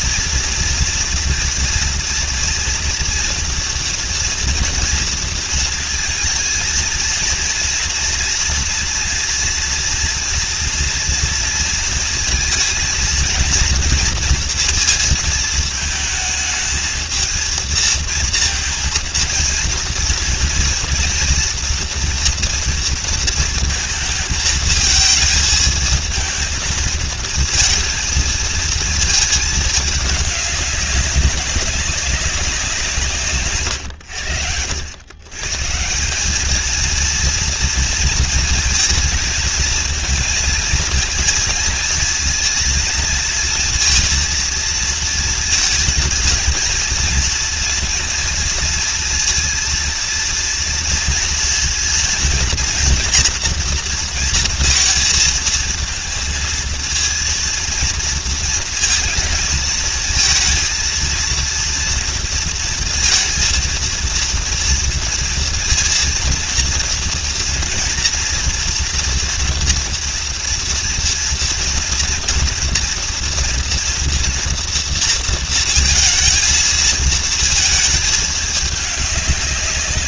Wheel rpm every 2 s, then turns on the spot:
230, 230, 230, 230, 240, 230, 230, 230, 220, 230, 240, 230, 220, 220, 220, 200, 170, 100, 230, 230, 230, 230, 230, 220, 230, 230, 240, 230, 230, 230, 230, 230, 230, 230, 230, 230, 240, 230, 230, 210.
none